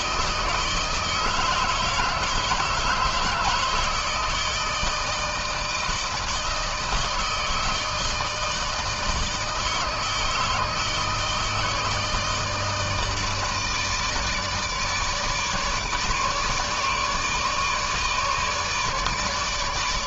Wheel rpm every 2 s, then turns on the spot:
160, 160, 160, 160, 160, 160, 160, 150, 150, 150.
none